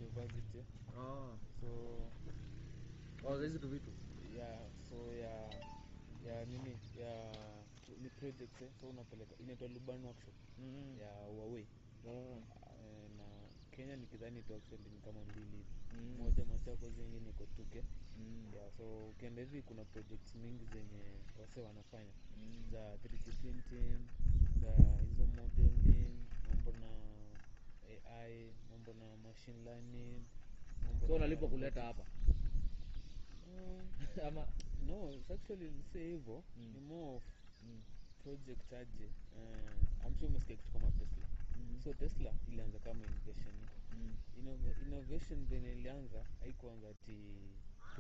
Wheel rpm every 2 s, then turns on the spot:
0, 0, 0, 0, 0, 0, 0, 0, 0, 0, 0, 0, 0, 0, 0, 0, 0, 0, 0, 0, 0, 0, 0, 0.
none